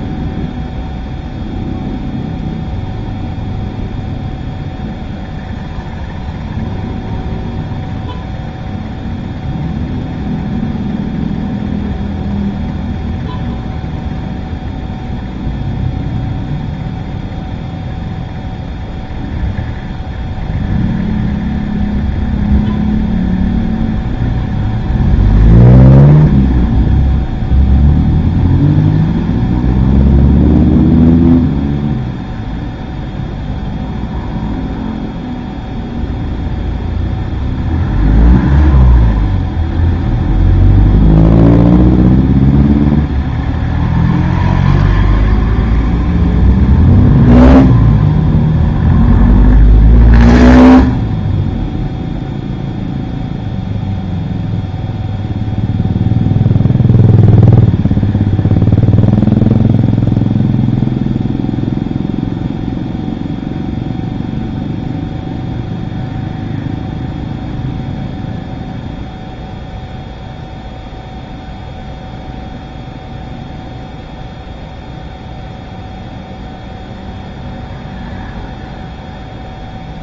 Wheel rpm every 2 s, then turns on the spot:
0, 0, 0, 0, 0, 0, 0, 0, 0, 0, 0, 0, 0, 0, 0, 0, 0, 0, 0, 0, 0, 0, 0, 0, 0, 0, 0, 0, 0, 0, 0, 0, 0, 0, 0, 0, 0, 0, 0, 0.
none